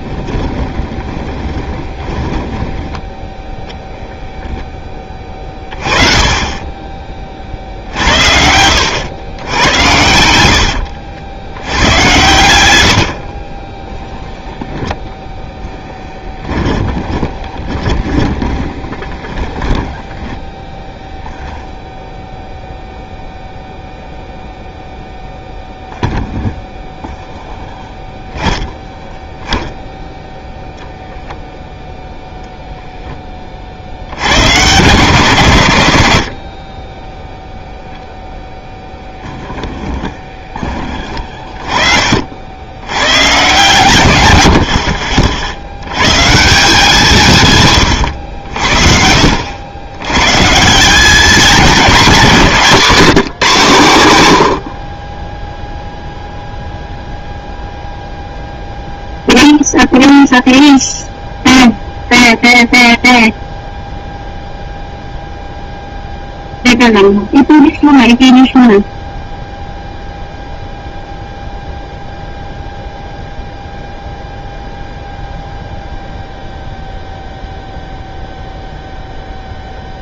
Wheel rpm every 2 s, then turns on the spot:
20, 10, 10, 20, 80, 80, 90, 0, 20, 20, 10, 0, 0, 0, 0, 0, 0, 110, 40, 0, 20, 80, 80, 160, 70, 160, 190, 90, 0, 0, 0, 0, 0, 0, 0, 0, 0, 0, 0, 0.
0-4 10-14 16-20 44-46